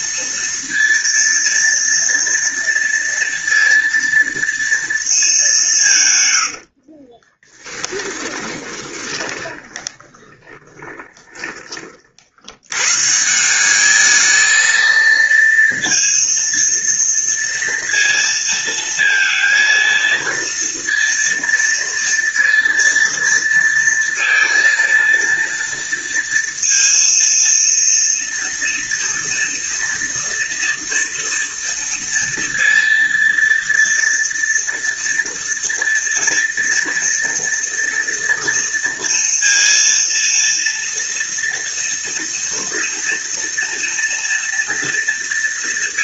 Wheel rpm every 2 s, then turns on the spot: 230, 230, 200, 30, 20, 20, 160, 230, 230, 230, 230, 230, 230, 230, 230, 230, 230, 230, 230, 230, 230, 230, 230.
6-12